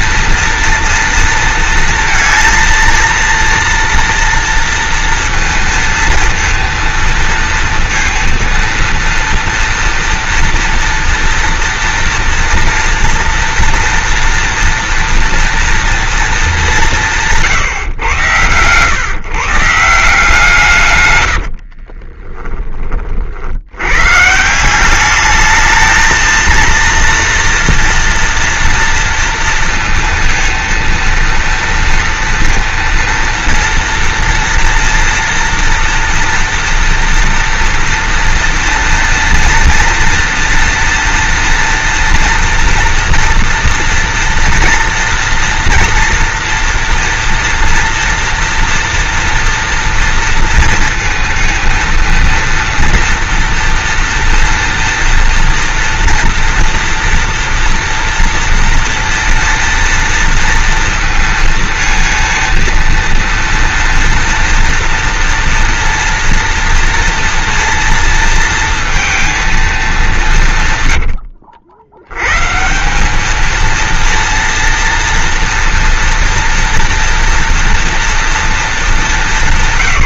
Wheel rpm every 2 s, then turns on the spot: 230, 230, 230, 230, 230, 230, 230, 230, 200, 130, 140, 30, 180, 230, 230, 230, 230, 230, 230, 230, 240, 230, 230, 230, 230, 230, 230, 230, 230, 230, 230, 230, 230, 230, 230, 120, 160, 230, 230, 180.
none